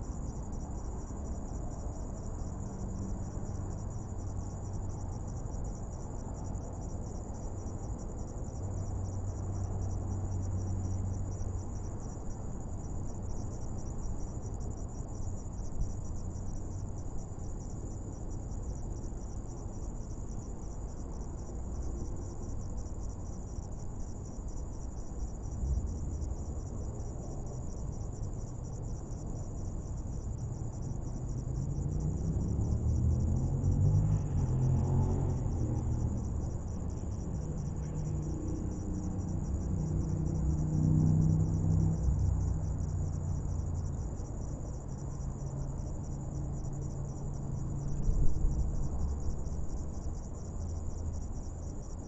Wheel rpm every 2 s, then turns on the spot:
0, 0, 0, 0, 0, 0, 0, 0, 0, 0, 0, 0, 0, 0, 0, 0, 0, 0, 0, 0, 0, 0, 0, 0, 0, 0.
none